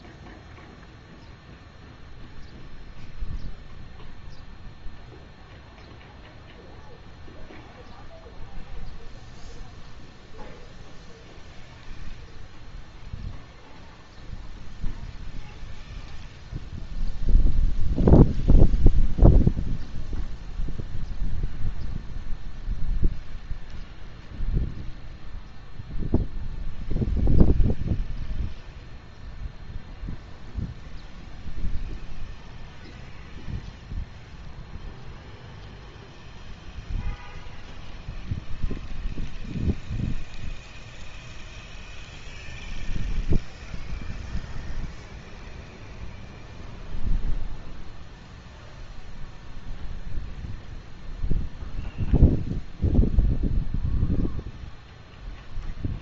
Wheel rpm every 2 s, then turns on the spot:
0, 0, 0, 0, 0, 0, 0, 0, 0, 0, 0, 0, 0, 0, 0, 0, 0, 0, 0, 0, 0, 0, 0, 0, 0, 0, 0, 0.
none